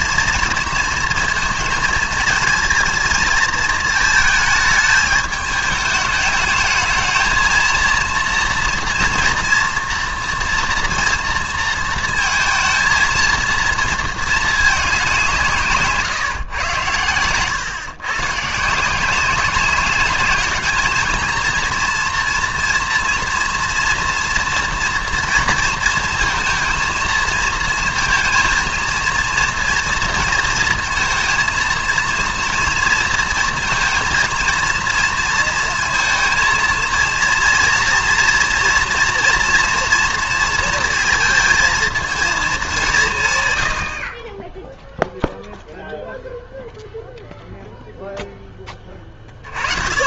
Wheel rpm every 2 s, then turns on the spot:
230, 220, 220, 210, 230, 230, 220, 210, 110, 150, 220, 230, 240, 230, 230, 230, 230, 230, 230, 230, 230, 210, 10, 0, 20.
none